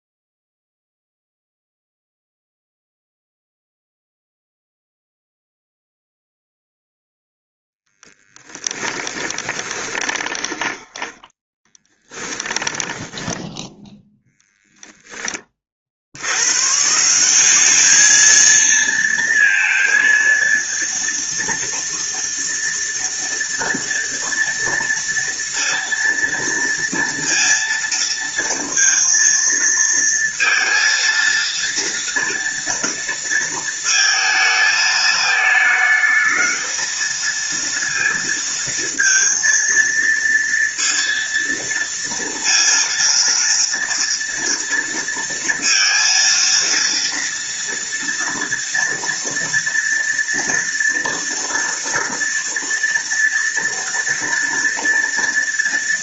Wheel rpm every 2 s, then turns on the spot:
0, 0, 0, 0, 20, 10, 10, 10, 140, 230, 230, 230, 230, 230, 230, 230, 230, 220, 220, 230, 230, 230, 230, 230, 230, 230, 240, 230.
8-14